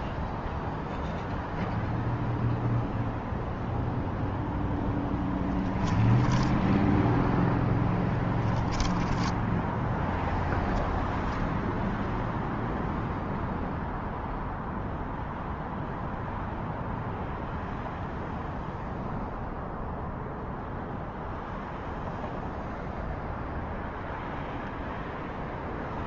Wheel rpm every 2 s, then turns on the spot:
0, 0, 10, 10, 10, 0, 0, 0, 0, 0, 0, 0, 0.
4-6 8-10